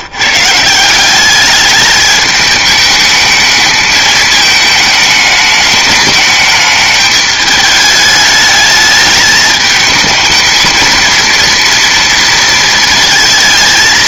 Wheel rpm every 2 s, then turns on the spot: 160, 210, 220, 210, 210, 230, 230.
none